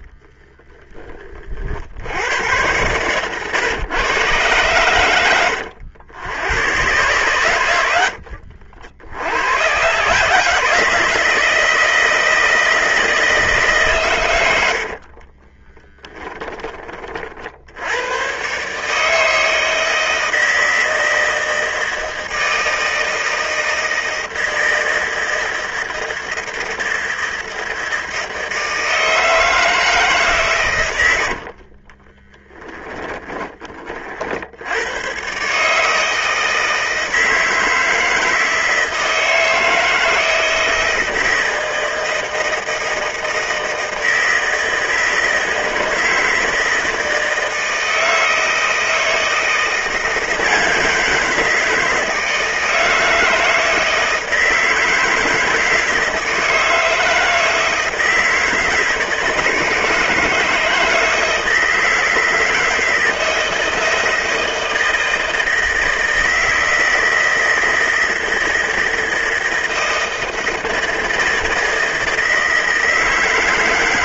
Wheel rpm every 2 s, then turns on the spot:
20, 120, 110, 110, 80, 160, 160, 60, 30, 150, 160, 160, 160, 160, 160, 110, 10, 100, 160, 160, 160, 160, 160, 160, 160, 170, 160, 160, 160, 160, 160, 160, 160, 160, 160, 160, 160.
14-16